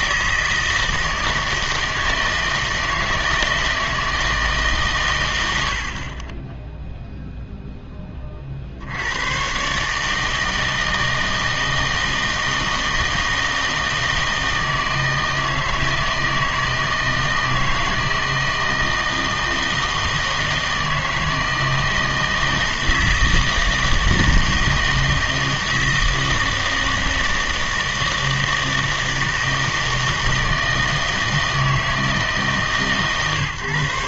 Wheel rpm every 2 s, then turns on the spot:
160, 160, 140, 0, 60, 160, 160, 160, 160, 160, 160, 160, 160, 160, 160, 160, 140.
none